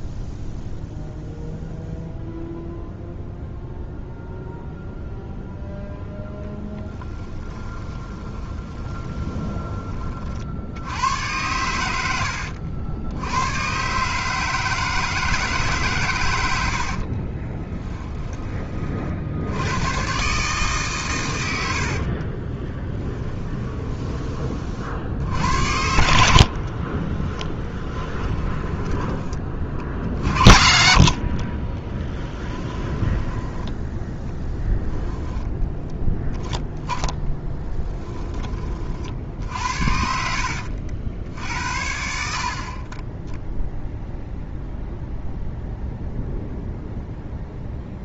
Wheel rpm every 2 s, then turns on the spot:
0, 0, 0, 10, 20, 80, 70, 150, 80, 30, 130, 20, 50, 60, 10, 40, 10, 10, 10, 30, 70, 40, 0, 0.
6-10 22-24 26-30 32-34 36-38